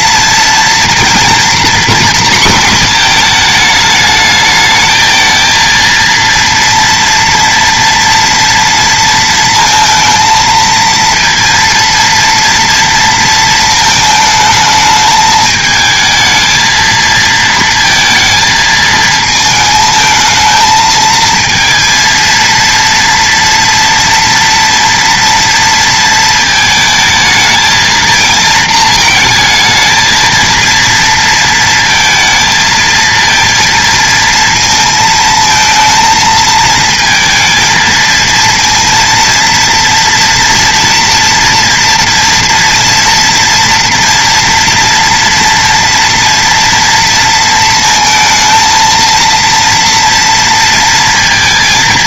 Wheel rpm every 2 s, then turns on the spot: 230, 230, 220, 230, 230, 230, 230, 220, 220, 220, 220, 230, 230, 220, 220, 230, 220, 230, 220, 230, 230, 230, 230, 230, 230, 230.
none